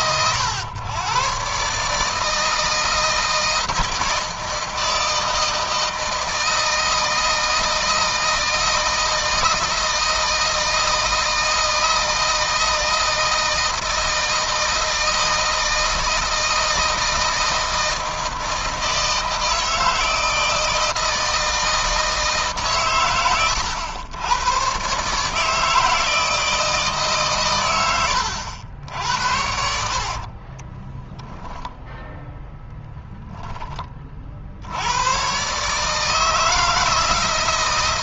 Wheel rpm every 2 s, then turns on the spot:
110, 160, 160, 160, 160, 160, 160, 160, 160, 160, 160, 130, 120, 150, 80, 20, 10, 80, 160.
30-32